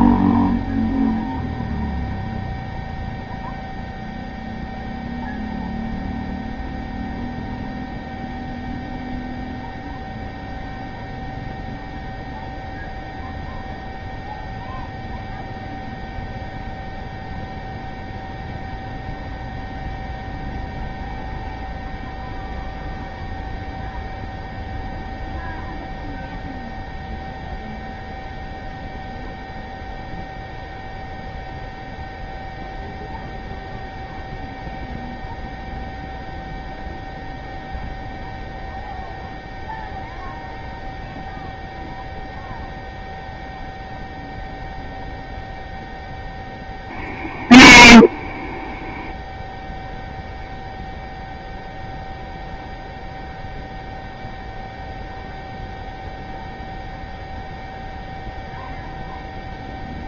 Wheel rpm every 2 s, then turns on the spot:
0, 0, 0, 0, 0, 0, 0, 0, 0, 0, 0, 0, 0, 0, 0, 0, 0, 0, 0, 0, 0, 0, 0, 0, 0, 0, 0, 0, 0, 0.
none